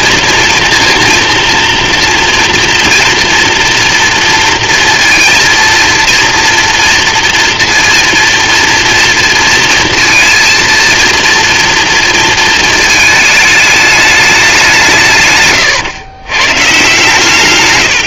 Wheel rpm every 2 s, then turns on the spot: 230, 230, 230, 230, 230, 230, 220, 140, 150.
none